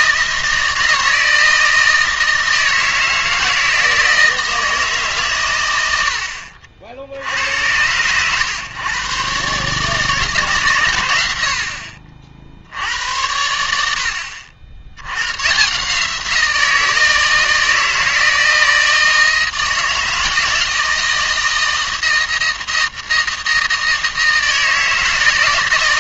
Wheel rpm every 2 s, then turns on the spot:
160, 160, 160, 70, 120, 130, 70, 80, 160, 160, 160, 160, 160.
none